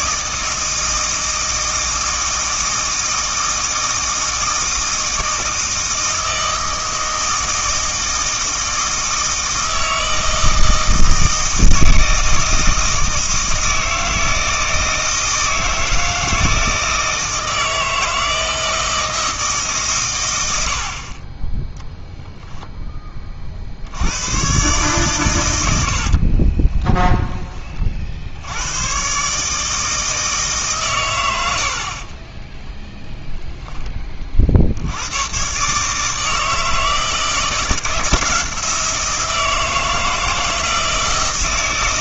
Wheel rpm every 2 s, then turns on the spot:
160, 160, 160, 160, 160, 160, 160, 160, 160, 160, 80, 10, 130, 10, 110, 130, 10, 90, 160, 170, 160.
26-28 32-34